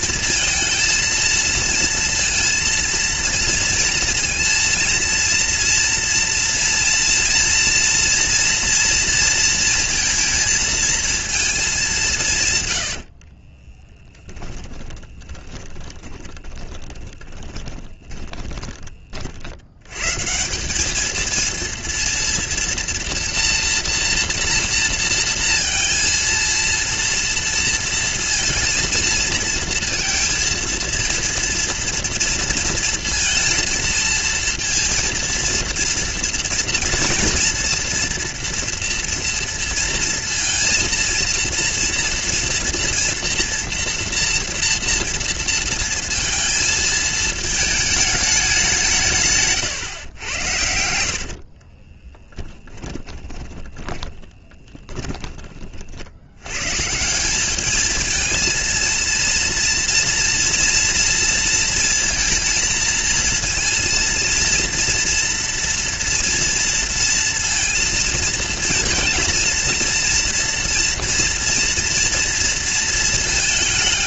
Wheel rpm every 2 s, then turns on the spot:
230, 230, 230, 230, 230, 230, 130, 20, 20, 30, 190, 230, 240, 230, 230, 230, 230, 230, 230, 240, 230, 230, 230, 230, 200, 80, 20, 20, 110, 230, 230, 220, 230, 230, 230, 230, 230.
12-20 52-56